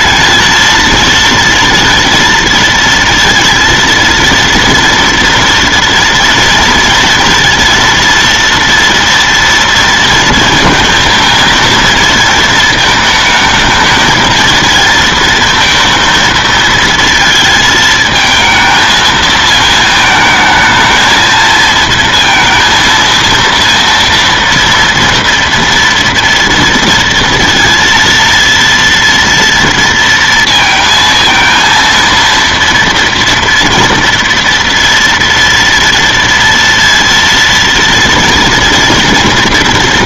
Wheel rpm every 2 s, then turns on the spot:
220, 230, 230, 230, 230, 230, 220, 230, 230, 220, 220, 230, 230, 230, 230, 230, 230, 230, 230, 230.
none